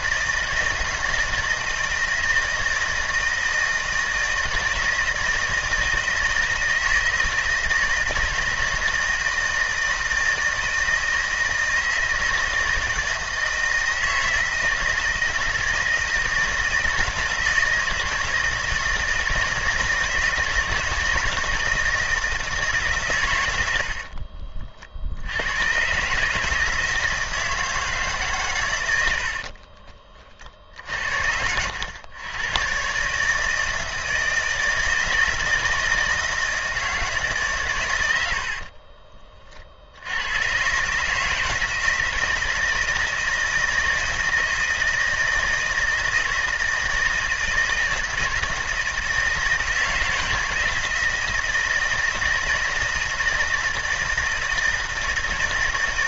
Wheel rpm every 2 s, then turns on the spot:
160, 160, 160, 160, 160, 160, 170, 160, 160, 160, 160, 140, 60, 160, 90, 50, 130, 160, 160, 30, 140, 160, 160, 160, 160, 160, 160, 160.
38-40